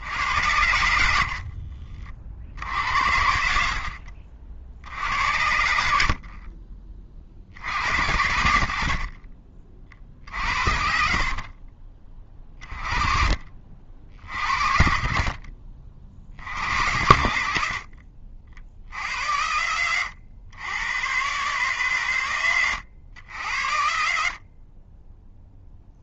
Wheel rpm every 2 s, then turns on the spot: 30, 60, 70, 70, 40, 40, 40, 50, 70, 80, 130, 80, 10.
4-6 10-12